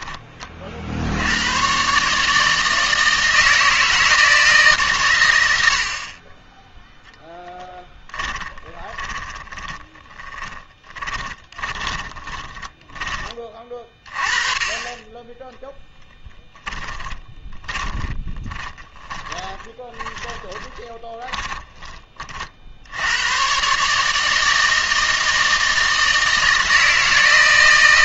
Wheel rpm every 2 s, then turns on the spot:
50, 160, 140, 10, 20, 20, 20, 20, 10, 30, 20, 70, 160, 160.
8-14 16-22